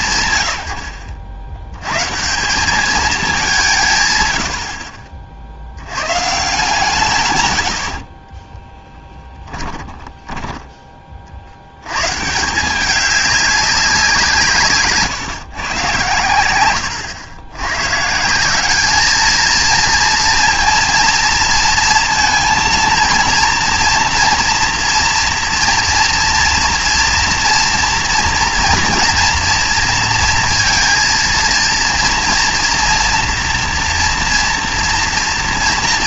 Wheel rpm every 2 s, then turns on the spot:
100, 210, 50, 160, 20, 20, 180, 140, 100, 200, 230, 230, 230, 230, 230, 230, 230, 230.
8-12